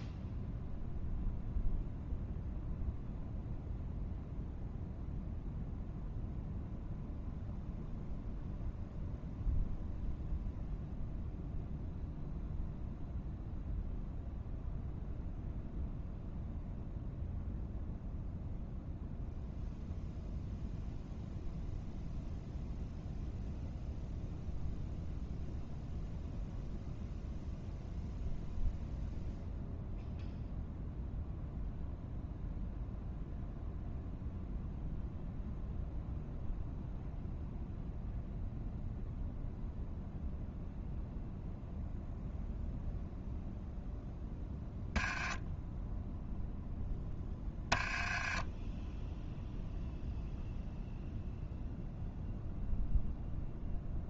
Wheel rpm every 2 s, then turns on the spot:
0, 0, 0, 0, 0, 0, 0, 0, 0, 0, 0, 0, 0, 0, 0, 0, 0, 0, 0, 0, 0, 0, 10, 0, 10, 0, 0.
none